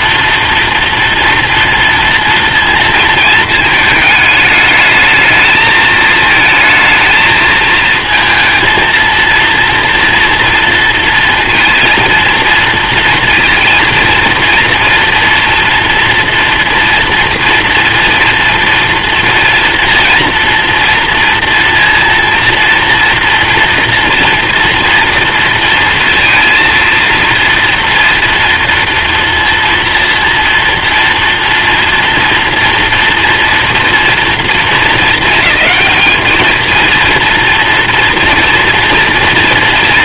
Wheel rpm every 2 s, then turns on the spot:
240, 230, 210, 220, 220, 230, 230, 240, 230, 230, 230, 230, 230, 230, 230, 240, 230, 220, 220, 240.
none